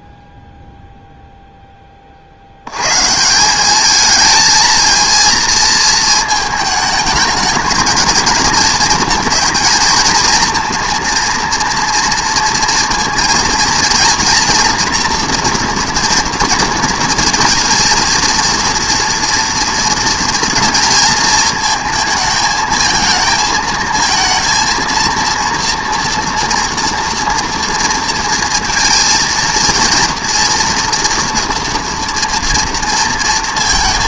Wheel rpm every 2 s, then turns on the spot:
0, 80, 220, 220, 220, 230, 230, 240, 230, 230, 230, 220, 230, 230, 230, 230, 230.
none